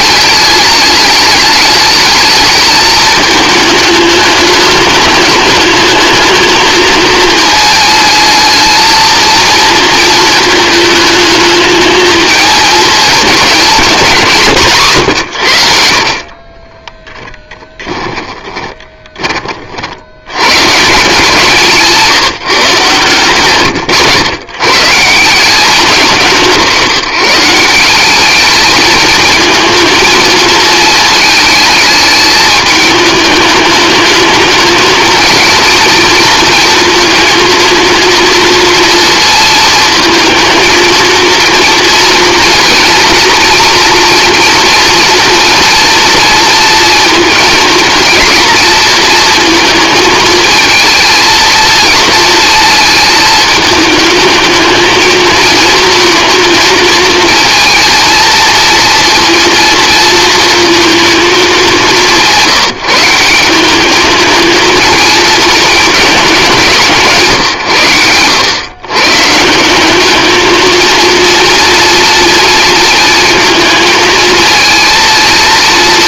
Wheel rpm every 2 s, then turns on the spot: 210, 210, 210, 220, 220, 220, 210, 140, 20, 20, 140, 160, 120, 170, 220, 220, 210, 220, 230, 230, 220, 230, 230, 230, 220, 220, 220, 220, 220, 230, 230, 170, 220, 190, 120, 220, 230, 230.
16-20